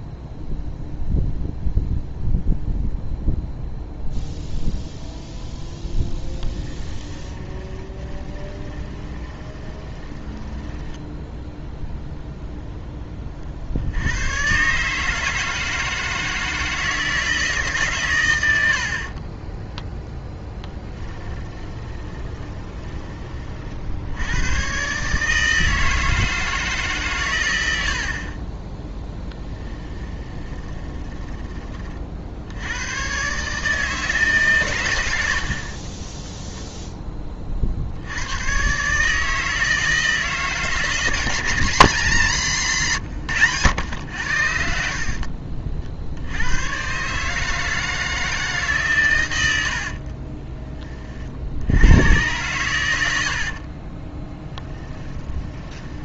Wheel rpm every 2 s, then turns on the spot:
0, 0, 0, 10, 20, 20, 0, 130, 160, 90, 10, 10, 110, 150, 20, 20, 80, 120, 0, 120, 160, 140, 60, 100, 150, 20, 110, 10.
6-12 20-24 28-32 50-52 54-56